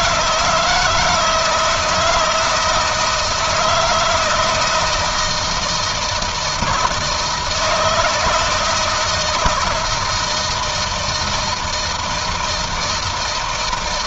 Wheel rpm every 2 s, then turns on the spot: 170, 160, 160, 160, 160, 160, 160.
none